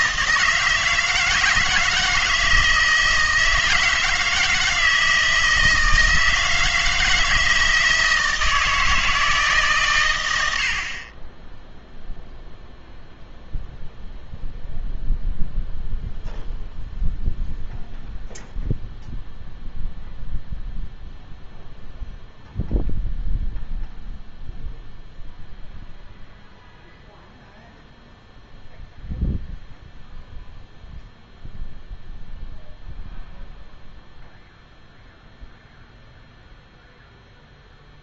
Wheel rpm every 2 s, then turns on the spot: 160, 160, 160, 160, 160, 80, 0, 0, 0, 0, 0, 0, 0, 0, 0, 0, 0, 0, 0.
none